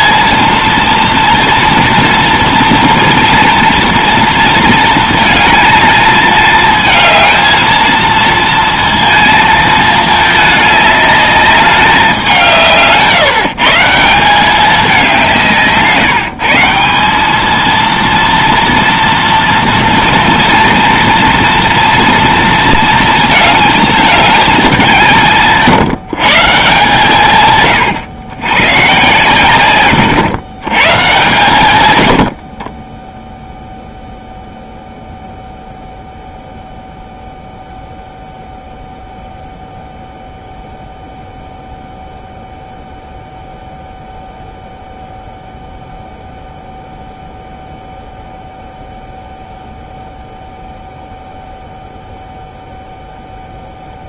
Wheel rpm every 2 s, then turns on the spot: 230, 230, 230, 220, 230, 210, 150, 200, 170, 230, 230, 230, 190, 150, 120, 130, 40, 0, 0, 0, 0, 0, 0, 0, 0, 0, 0.
none